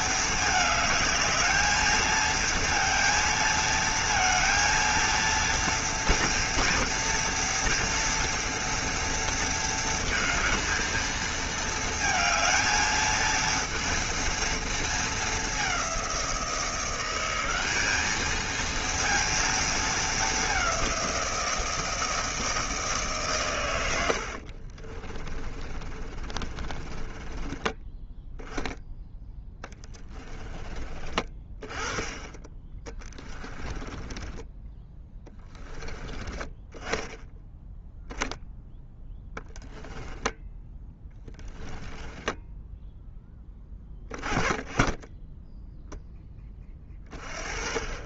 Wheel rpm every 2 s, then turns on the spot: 220, 230, 230, 230, 230, 220, 220, 220, 180, 230, 180, 160, 30, 20, 10, 30, 30, 10, 30, 10, 10, 10, 10, 30.
24-28 32-36 40-42